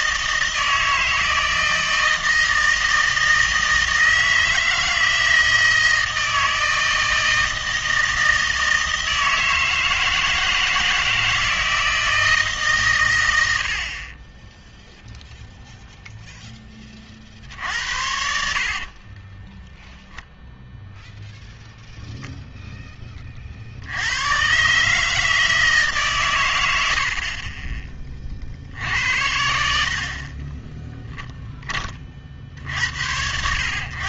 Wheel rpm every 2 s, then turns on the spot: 160, 160, 160, 160, 160, 160, 140, 0, 10, 50, 0, 10, 140, 80, 70, 20, 70.
18-20 30-32